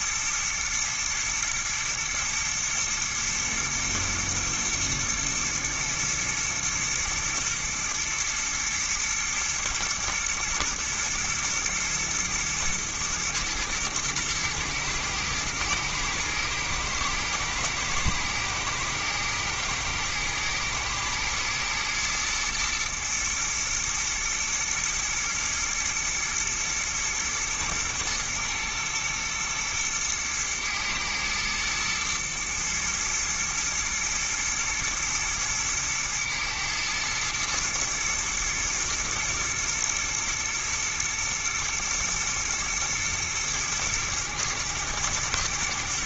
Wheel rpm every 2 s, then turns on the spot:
120, 110, 110, 110, 120, 120, 110, 110, 120, 110, 110, 110, 120, 120, 110, 120, 110, 110, 110, 110, 120, 110, 110.
none